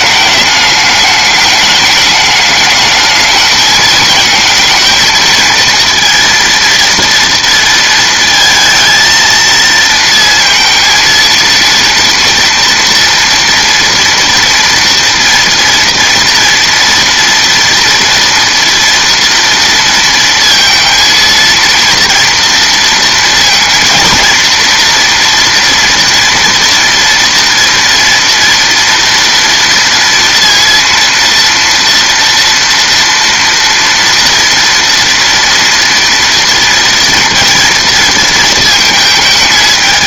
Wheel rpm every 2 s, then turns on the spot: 210, 220, 220, 230, 230, 230, 230, 230, 230, 230, 230, 230, 230, 240, 230, 230, 230, 230, 230, 220.
none